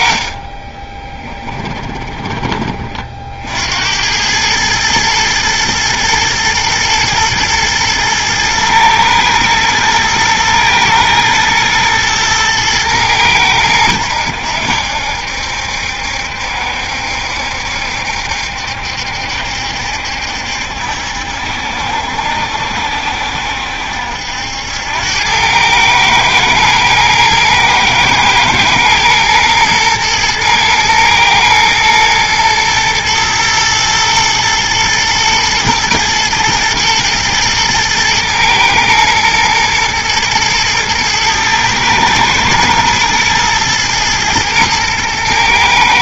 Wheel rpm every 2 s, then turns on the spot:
20, 40, 110, 110, 110, 120, 110, 80, 70, 70, 70, 70, 90, 110, 110, 110, 110, 110, 110, 110, 110, 110, 110.
0-2